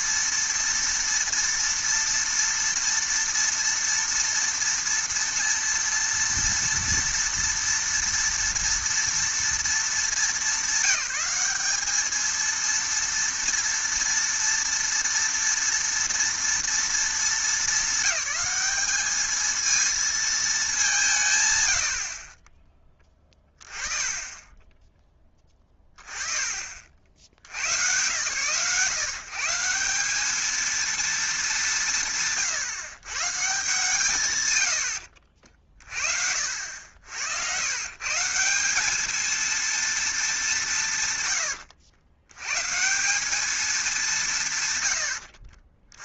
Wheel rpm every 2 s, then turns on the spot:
230, 230, 230, 230, 230, 200, 230, 230, 230, 210, 200, 10, 20, 50, 130, 220, 130, 120, 70, 190, 190, 120, 130.
none